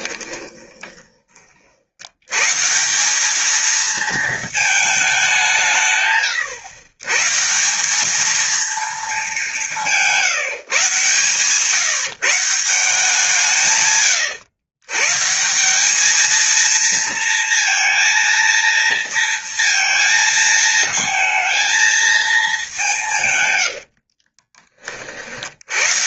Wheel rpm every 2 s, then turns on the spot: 20, 150, 220, 110, 220, 150, 170, 110, 230, 230, 220, 200, 40.
0-2